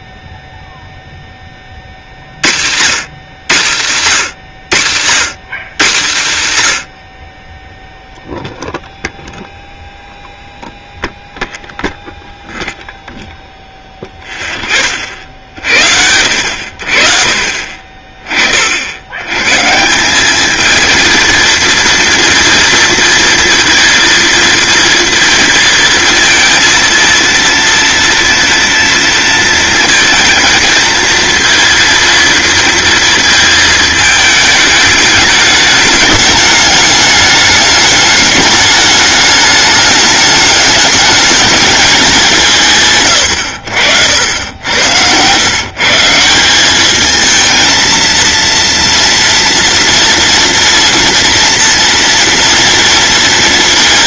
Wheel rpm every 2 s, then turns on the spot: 0, 110, 120, 80, 0, 0, 0, 30, 60, 80, 230, 230, 230, 230, 230, 230, 230, 210, 210, 210, 210, 130, 90, 210, 230, 230, 230.
none